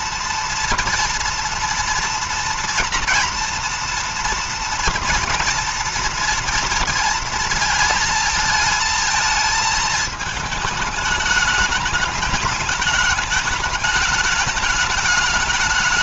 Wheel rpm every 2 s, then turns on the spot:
230, 230, 230, 230, 220, 220, 210, 210.
none